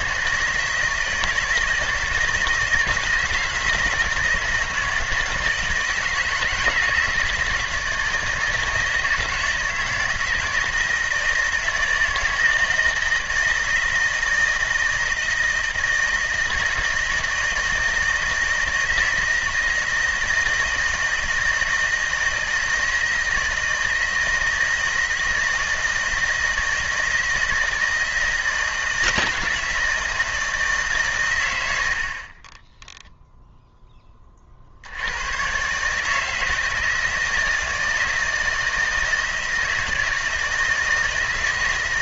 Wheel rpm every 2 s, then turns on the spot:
160, 160, 160, 160, 160, 160, 160, 160, 160, 160, 160, 160, 160, 160, 160, 150, 10, 70, 160, 160, 160.
32-34